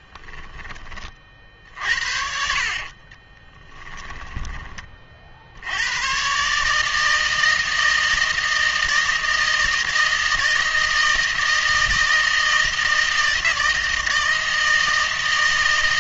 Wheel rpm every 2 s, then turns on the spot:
10, 60, 20, 140, 160, 160, 160, 160.
0-4